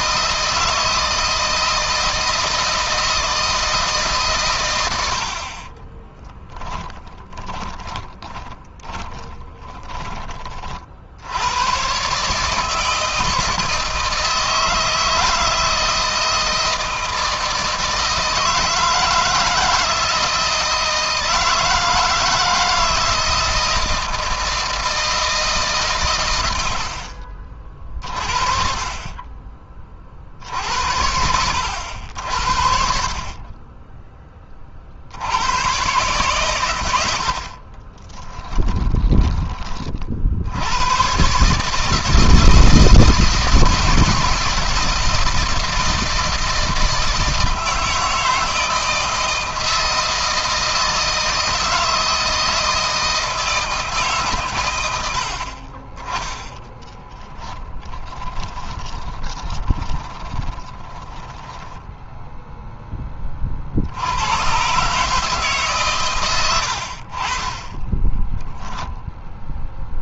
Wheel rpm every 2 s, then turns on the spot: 160, 160, 100, 10, 10, 40, 150, 160, 160, 160, 160, 160, 160, 90, 30, 80, 50, 50, 100, 10, 100, 160, 160, 160, 160, 160, 160, 110, 20, 20, 10, 10, 130, 70, 10.
6-10 38-40 56-62 68-70